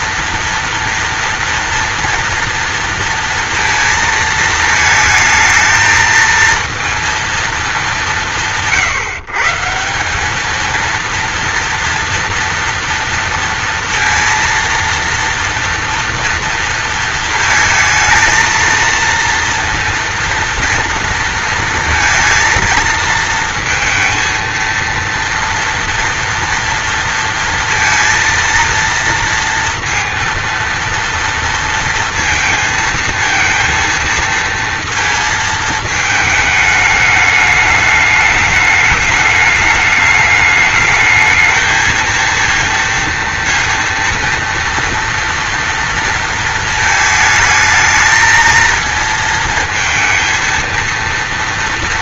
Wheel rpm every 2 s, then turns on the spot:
230, 230, 220, 230, 150, 230, 230, 230, 230, 230, 230, 230, 230, 230, 230, 230, 230, 230, 210, 210, 220, 230, 230, 220, 230, 230.
none